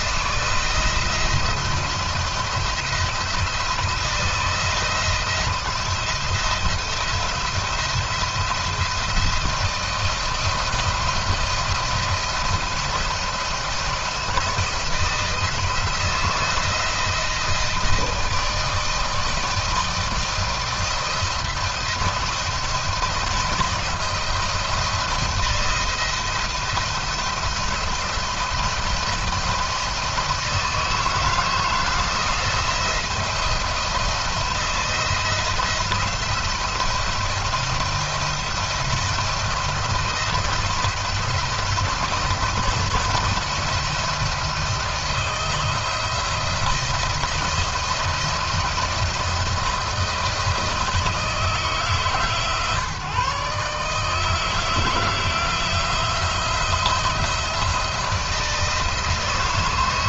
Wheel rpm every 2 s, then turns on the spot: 170, 160, 170, 170, 170, 170, 170, 170, 160, 160, 170, 170, 170, 170, 160, 160, 170, 170, 170, 170, 170, 170, 160, 170, 170, 160, 150, 160, 170, 160.
none